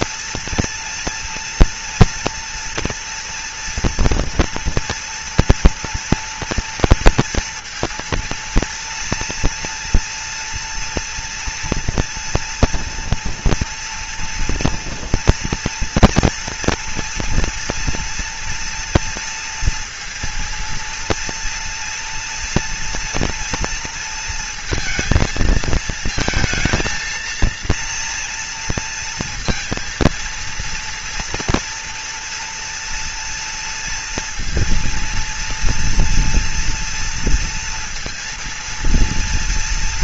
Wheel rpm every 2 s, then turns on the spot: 230, 230, 240, 230, 230, 230, 230, 230, 230, 240, 230, 240, 230, 220, 230, 230, 240, 230, 230, 230.
none